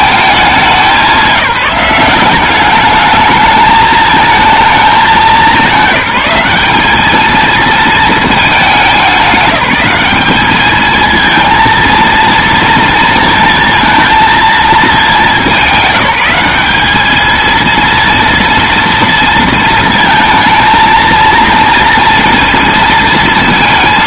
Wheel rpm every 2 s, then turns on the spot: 190, 200, 220, 210, 200, 220, 230, 210, 210, 230, 230, 230.
none